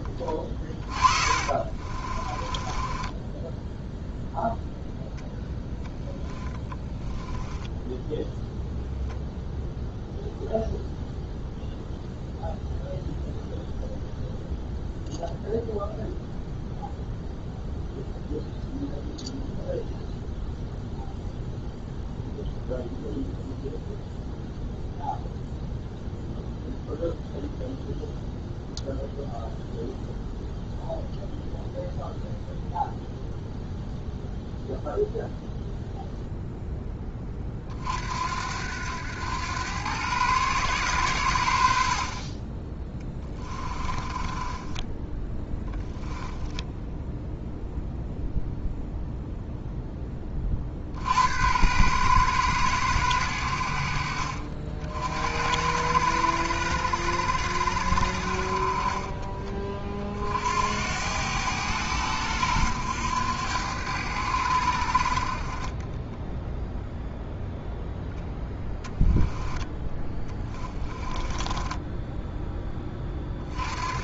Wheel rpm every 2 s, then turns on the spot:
30, 20, 0, 10, 0, 0, 0, 0, 0, 0, 0, 0, 0, 0, 0, 0, 0, 0, 10, 90, 110, 20, 10, 0, 0, 40, 110, 60, 90, 40, 70, 90, 80, 0, 10, 30, 10.
0-4 6-8 42-46 70-72